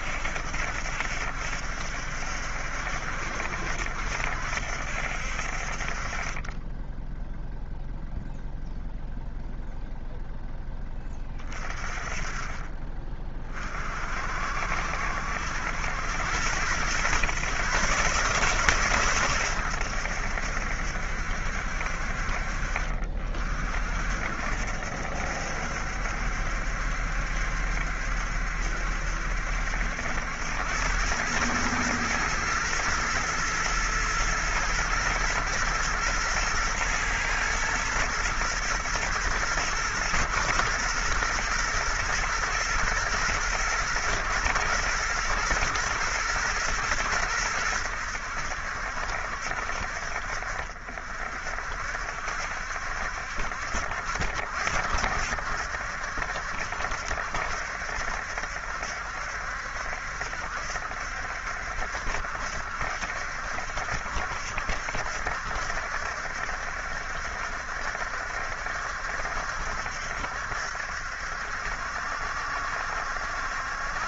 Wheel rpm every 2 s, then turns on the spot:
70, 70, 70, 20, 0, 10, 30, 60, 100, 130, 70, 40, 70, 70, 70, 90, 120, 110, 120, 120, 120, 110, 110, 110, 80, 60, 70, 70, 70, 70, 60, 70, 70, 70, 70, 70, 70.
none